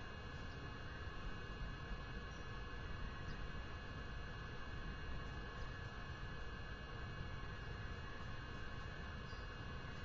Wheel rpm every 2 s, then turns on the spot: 0, 0, 0, 0, 0.
none